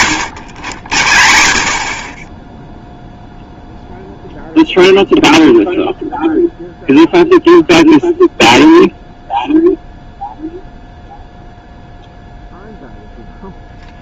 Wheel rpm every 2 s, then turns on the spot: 110, 10, 0, 0, 0, 0, 0.
none